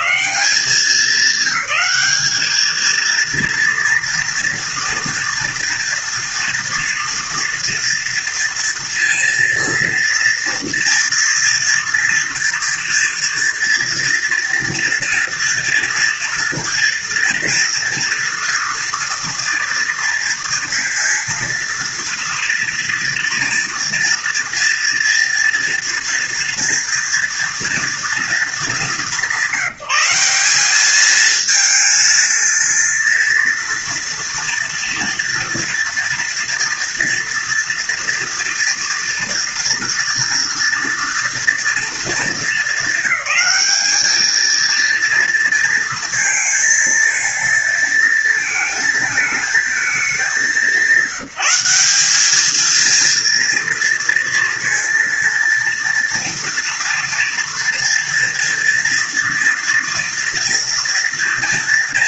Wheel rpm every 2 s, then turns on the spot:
200, 220, 230, 230, 230, 230, 230, 230, 230, 240, 230, 230, 230, 230, 210, 210, 230, 230, 230, 240, 230, 220, 230, 230, 220, 190, 230, 230, 230, 230, 230.
none